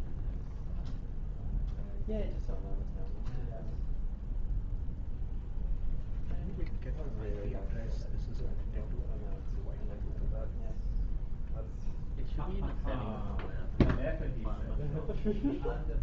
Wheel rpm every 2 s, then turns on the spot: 0, 0, 0, 0, 0, 0, 0, 0.
none